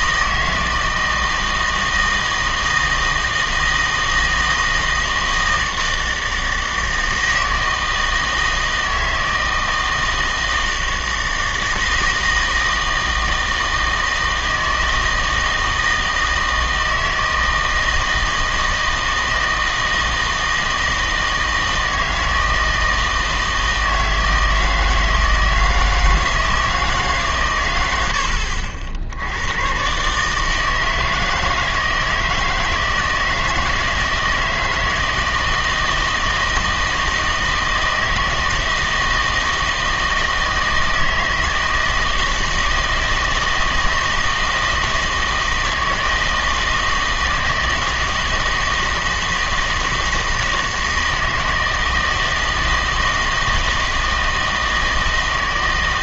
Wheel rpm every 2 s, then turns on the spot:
160, 160, 160, 160, 160, 160, 160, 160, 160, 160, 160, 160, 160, 160, 70, 160, 160, 160, 160, 160, 160, 160, 160, 160, 160, 160, 160, 160.
none